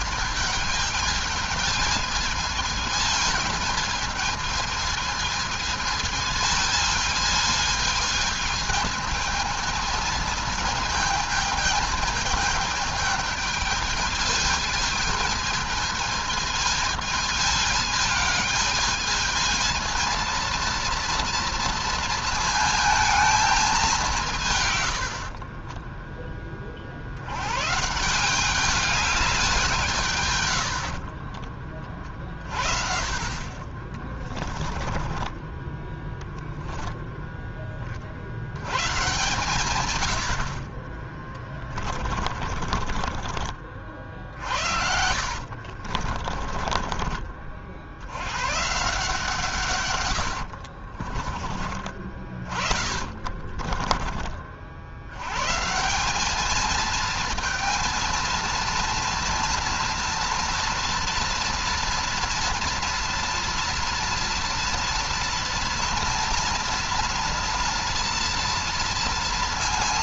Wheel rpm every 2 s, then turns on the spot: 210, 220, 220, 220, 220, 220, 220, 220, 220, 220, 230, 220, 80, 70, 200, 60, 40, 20, 0, 120, 30, 40, 60, 30, 140, 50, 40, 80, 220, 230, 230, 240, 230, 230, 230.
30-32 34-36 42-46 50-54